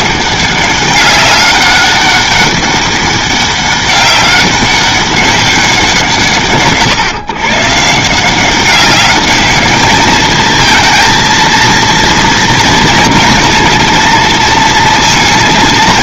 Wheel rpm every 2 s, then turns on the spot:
200, 200, 190, 140, 180, 220, 230, 230.
none